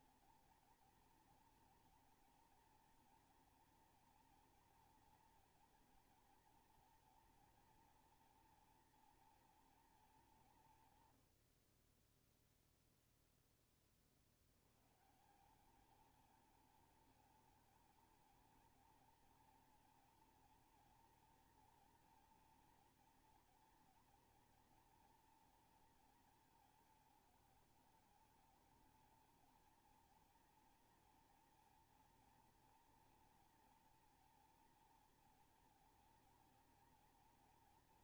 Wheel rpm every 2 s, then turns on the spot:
220, 230, 230, 230, 230, 180, 0, 70, 210, 220, 230, 240, 230, 220, 210, 230, 230, 230, 230.
none